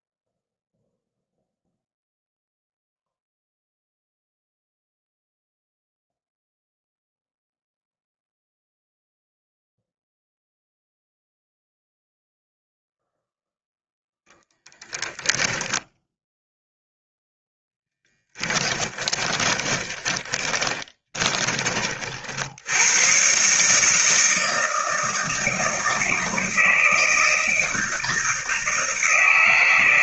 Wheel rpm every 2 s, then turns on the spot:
0, 0, 0, 0, 0, 0, 0, 10, 0, 20, 20, 100, 160, 160, 160.
18-22